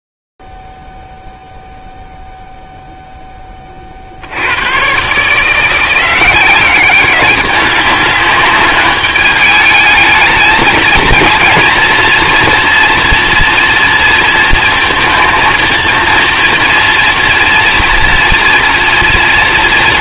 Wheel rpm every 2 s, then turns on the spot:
0, 0, 50, 170, 200, 210, 230, 230, 230, 230.
none